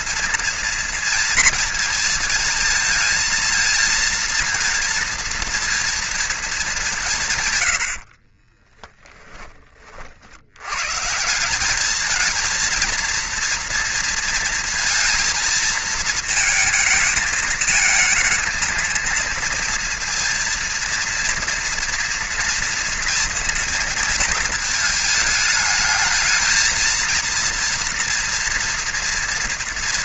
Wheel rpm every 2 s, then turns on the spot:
230, 220, 230, 220, 40, 90, 220, 230, 220, 230, 230, 230, 220, 220, 230.
8-10